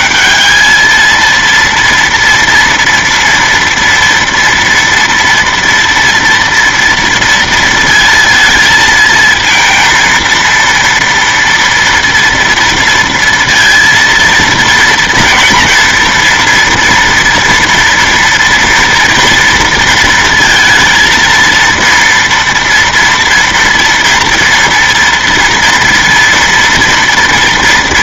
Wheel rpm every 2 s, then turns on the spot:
210, 230, 230, 230, 230, 230, 230, 230, 230, 240, 230, 240, 230, 230.
none